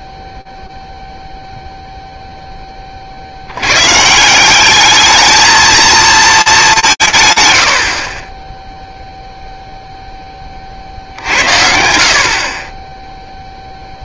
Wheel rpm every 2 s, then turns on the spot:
0, 0, 160, 220, 20, 40, 30.
none